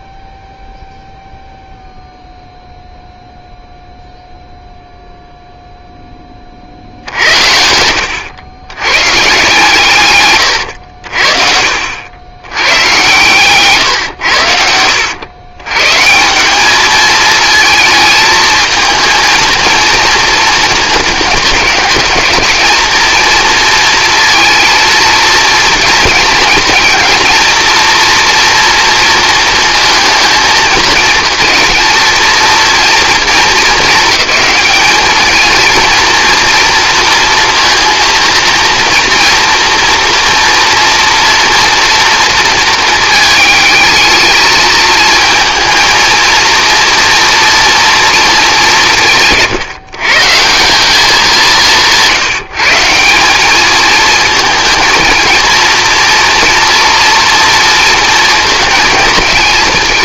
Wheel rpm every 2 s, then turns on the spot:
0, 0, 0, 50, 110, 110, 100, 90, 200, 220, 230, 220, 230, 230, 230, 220, 230, 210, 230, 230, 240, 230, 220, 230, 190, 180, 160, 230, 230, 220.
10-12 14-16